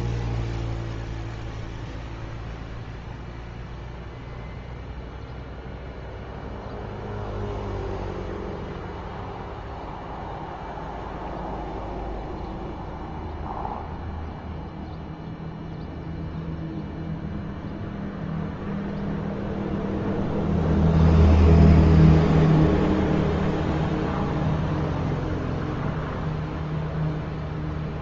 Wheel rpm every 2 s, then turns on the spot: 0, 0, 0, 0, 0, 0, 0, 0, 0, 0, 0, 0, 0, 0.
none